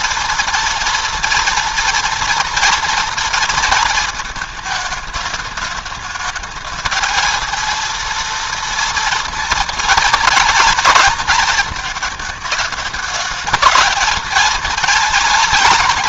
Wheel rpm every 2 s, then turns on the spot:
240, 230, 220, 220, 230, 220, 210, 220.
none